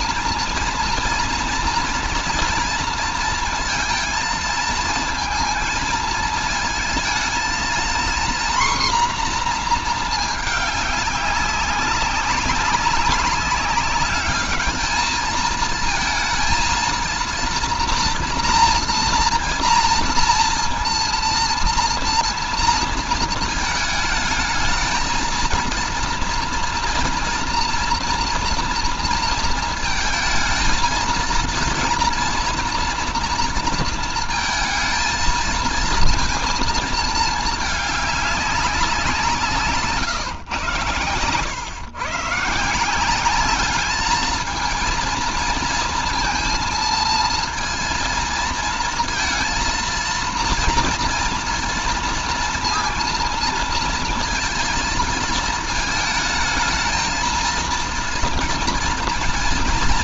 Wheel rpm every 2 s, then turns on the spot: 230, 230, 230, 220, 250, 210, 200, 210, 230, 230, 230, 230, 220, 230, 230, 220, 240, 220, 220, 190, 120, 160, 230, 230, 230, 230, 230, 220, 220, 230.
none